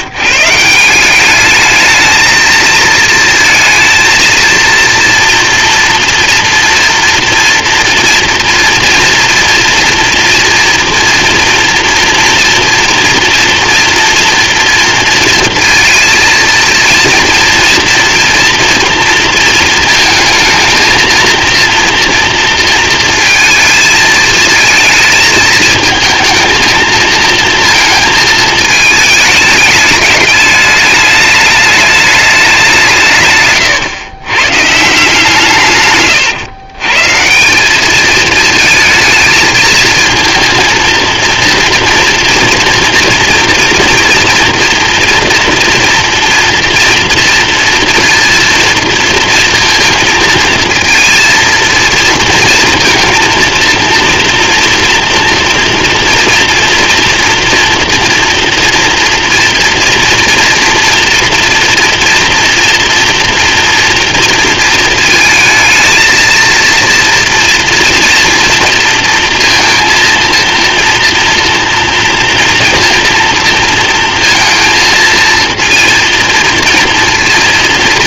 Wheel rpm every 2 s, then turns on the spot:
200, 230, 230, 230, 240, 230, 230, 230, 230, 230, 230, 230, 220, 230, 210, 210, 140, 150, 160, 220, 230, 240, 230, 230, 230, 230, 230, 230, 230, 230, 230, 230, 220, 230, 230, 230, 230, 230, 230.
none